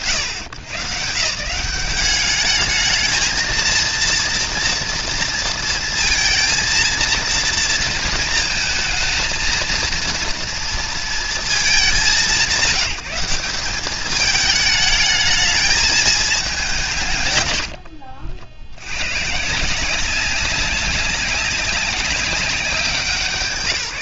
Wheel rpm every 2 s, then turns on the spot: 110, 210, 230, 230, 230, 230, 170, 220, 170, 90, 190, 190.
none